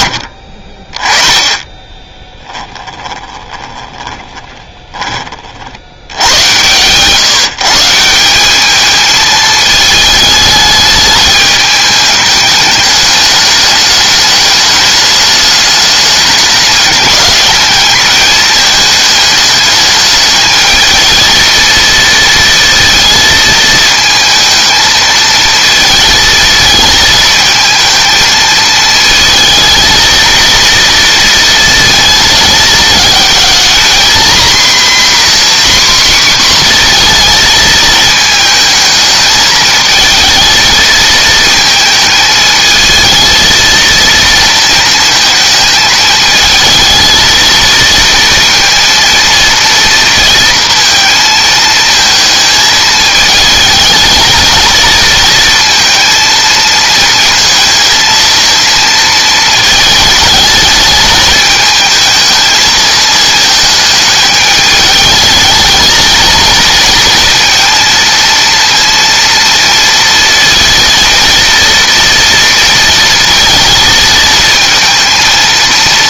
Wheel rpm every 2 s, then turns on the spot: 30, 10, 20, 120, 210, 210, 210, 210, 210, 210, 220, 230, 220, 220, 220, 230, 220, 260, 250, 220, 220, 220, 220, 220, 230, 230, 220, 230, 230, 230, 220, 220, 210, 230, 230, 230, 230, 230.
0-4